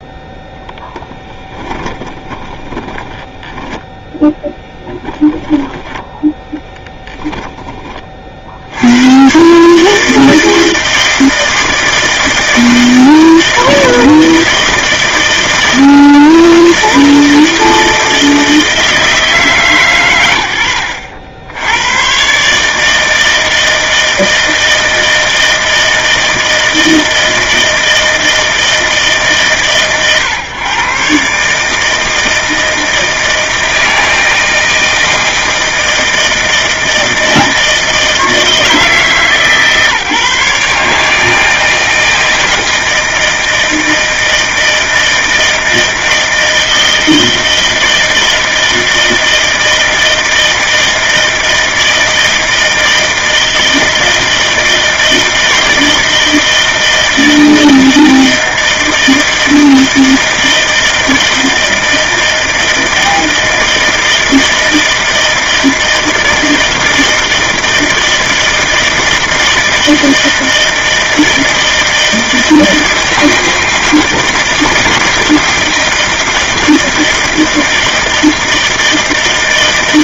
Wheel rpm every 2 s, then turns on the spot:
10, 10, 0, 10, 50, 160, 160, 160, 160, 160, 100, 140, 160, 160, 160, 120, 160, 160, 160, 160, 150, 160, 160, 160, 160, 160, 160, 160, 160, 160, 160, 160, 160, 160, 160, 160, 160, 160, 160, 160.
2-4 6-8